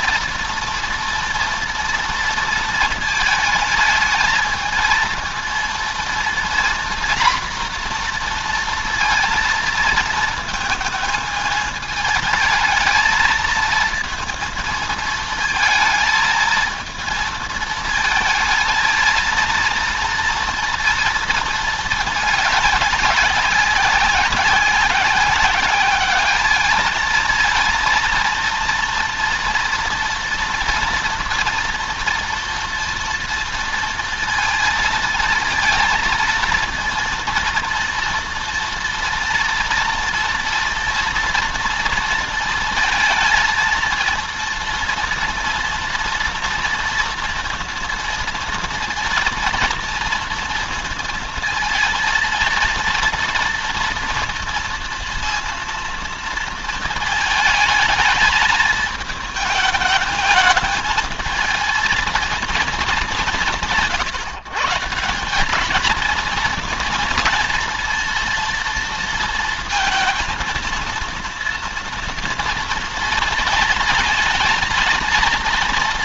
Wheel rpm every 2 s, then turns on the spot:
230, 230, 220, 240, 240, 220, 220, 230, 220, 220, 230, 200, 190, 210, 230, 240, 230, 230, 230, 230, 230, 230, 230, 230, 230, 230, 230, 230, 220, 220, 220, 210, 160, 230, 230, 230, 230, 230.
none